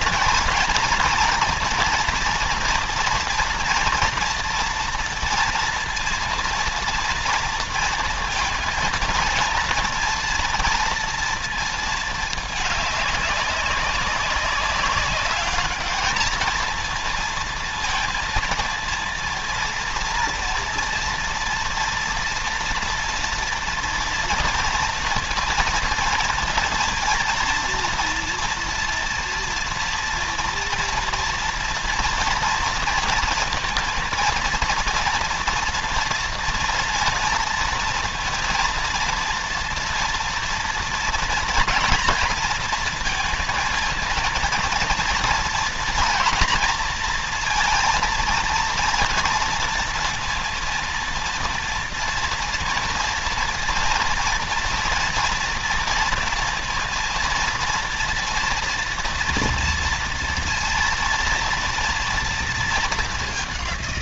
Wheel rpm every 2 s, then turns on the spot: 230, 230, 230, 230, 230, 230, 210, 190, 220, 230, 230, 230, 230, 230, 230, 230, 230, 230, 230, 230, 230, 230, 230, 240, 230, 230, 230, 230, 230, 230, 230, 230.
none